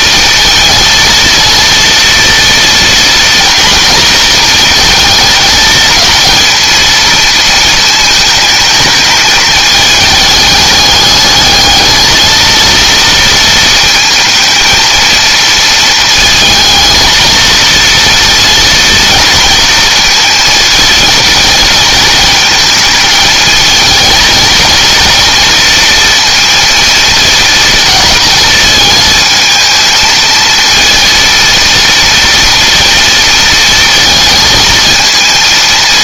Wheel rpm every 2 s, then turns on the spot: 220, 230, 220, 230, 220, 210, 230, 220, 220, 230, 220, 220, 230, 230, 220, 230, 230, 220.
none